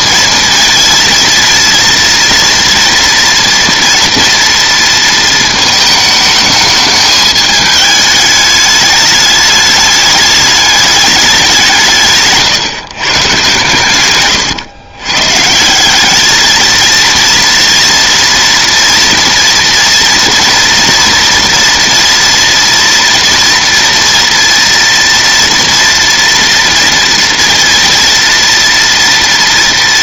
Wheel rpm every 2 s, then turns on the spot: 230, 230, 230, 210, 210, 210, 130, 120, 220, 230, 230, 230, 230, 230, 230.
none